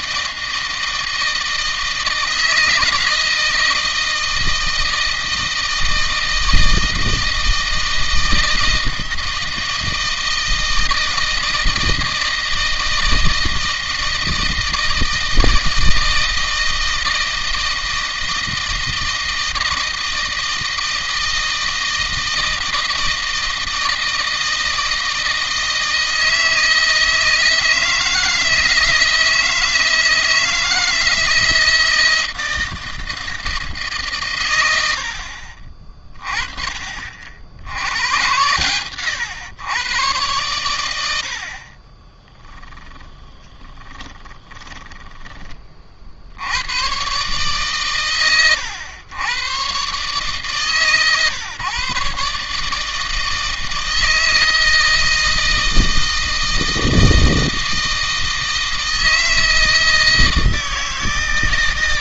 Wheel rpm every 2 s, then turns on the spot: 160, 160, 160, 160, 160, 160, 160, 160, 160, 160, 160, 160, 160, 160, 160, 160, 160, 120, 30, 110, 110, 20, 20, 90, 110, 140, 150, 160, 160, 160, 160.
42-46